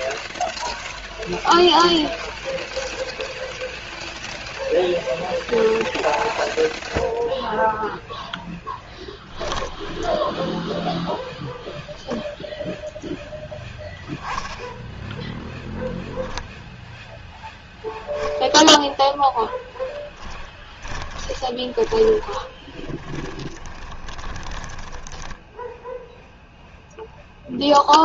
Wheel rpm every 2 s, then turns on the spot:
0, 0, 0, 0, 0, 10, 0, 0, 0, 0, 20, 20, 20, 0.
10-12 20-26